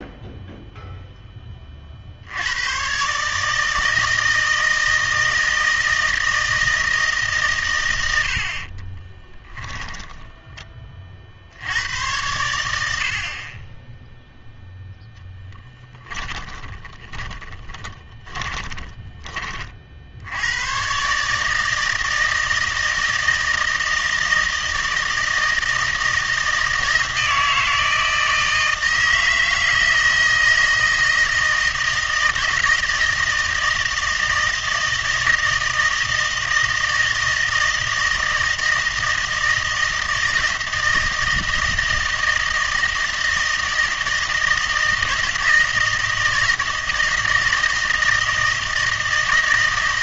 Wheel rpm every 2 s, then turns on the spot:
0, 100, 160, 160, 40, 20, 90, 0, 20, 20, 120, 160, 160, 160, 160, 160, 160, 160, 160, 160, 160, 160, 160, 160, 160.
8-10 16-20